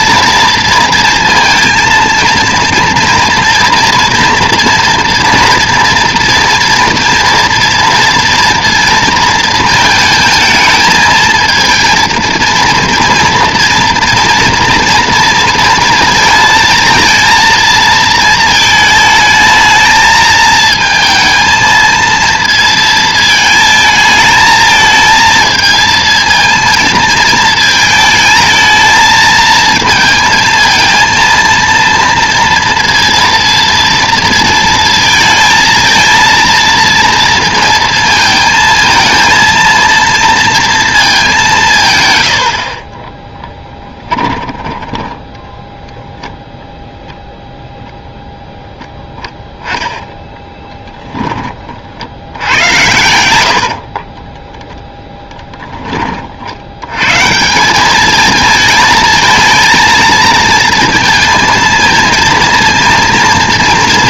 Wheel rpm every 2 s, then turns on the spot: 230, 230, 230, 230, 230, 220, 230, 230, 220, 220, 220, 230, 220, 220, 220, 220, 230, 230, 230, 220, 230, 60, 10, 0, 0, 10, 90, 10, 80, 220, 230, 230.
50-52